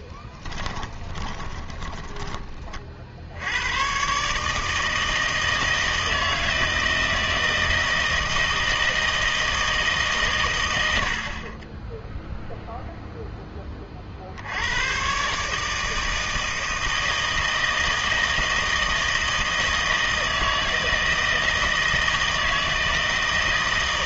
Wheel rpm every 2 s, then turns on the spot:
20, 40, 150, 160, 160, 100, 0, 90, 160, 160, 160, 160.
0-2